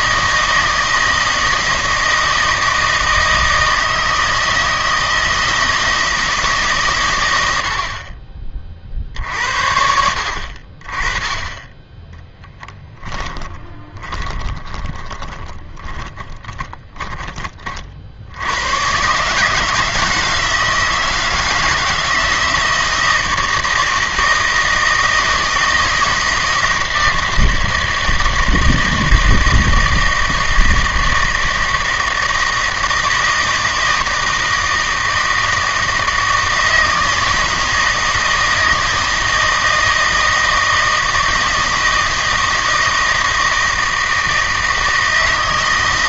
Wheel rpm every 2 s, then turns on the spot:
160, 160, 160, 140, 40, 40, 10, 20, 30, 110, 160, 160, 160, 160, 160, 160, 160, 160, 160, 160, 160, 160, 160.
12-18